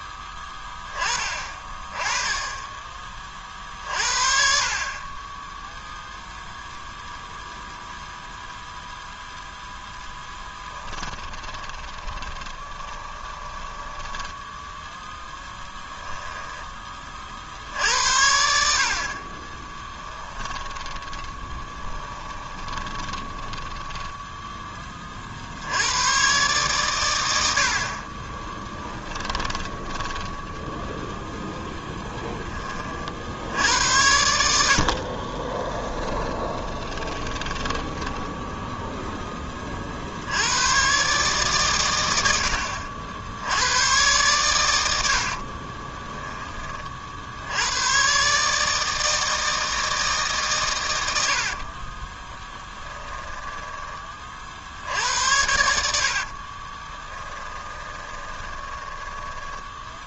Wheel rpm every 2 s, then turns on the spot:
20, 20, 60, 0, 0, 10, 20, 10, 20, 50, 20, 20, 20, 120, 20, 10, 30, 60, 20, 0, 110, 70, 90, 30, 150, 120, 20, 70, 30, 20.
10-14 20-24 28-30 36-38 52-54 56-60